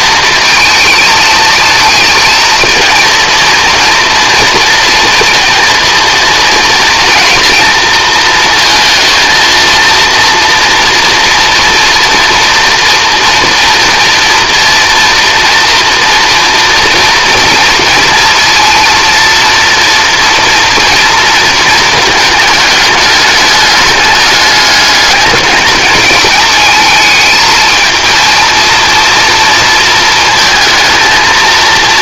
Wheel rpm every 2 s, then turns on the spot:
220, 220, 230, 230, 230, 240, 230, 230, 230, 230, 230, 210, 210, 220, 230, 230.
none